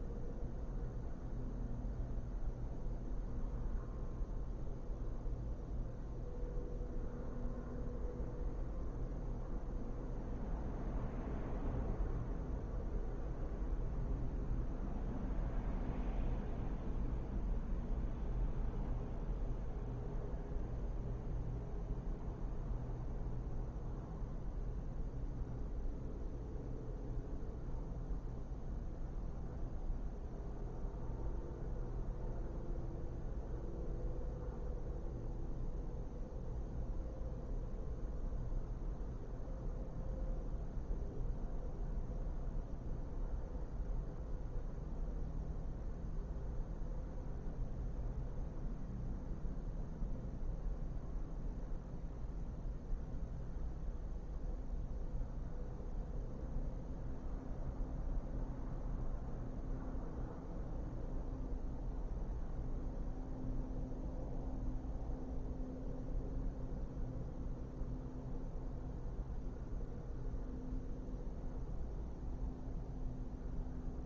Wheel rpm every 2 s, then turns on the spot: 0, 0, 0, 0, 0, 0, 0, 0, 0, 0, 0, 0, 0, 0, 0, 0, 0, 0, 0, 0, 0, 0, 0, 0, 0, 0, 0, 0, 0, 0, 0, 0, 0, 0, 0, 0, 0.
none